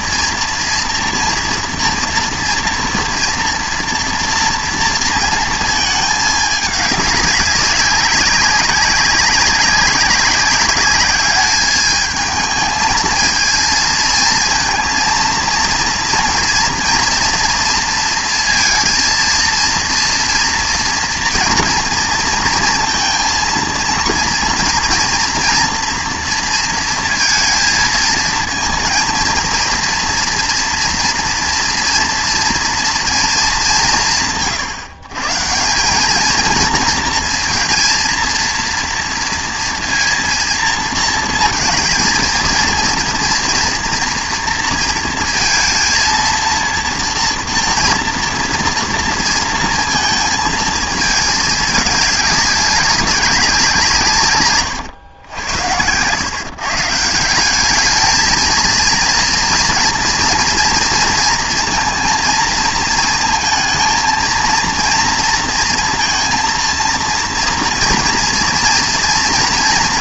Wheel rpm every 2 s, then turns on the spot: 230, 240, 230, 210, 200, 200, 220, 230, 230, 230, 240, 230, 230, 230, 230, 230, 230, 140, 230, 230, 230, 230, 230, 230, 230, 220, 200, 130, 140, 230, 230, 230, 230, 230, 230.
none